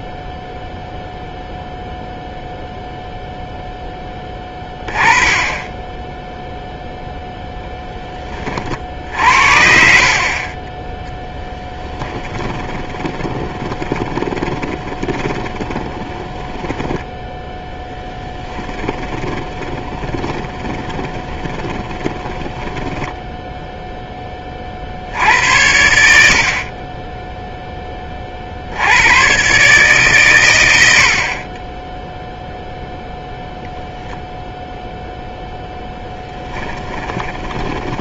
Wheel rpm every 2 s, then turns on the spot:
0, 0, 10, 0, 40, 20, 20, 20, 10, 20, 20, 10, 50, 30, 80, 90, 0, 0, 10.
12-24 36-38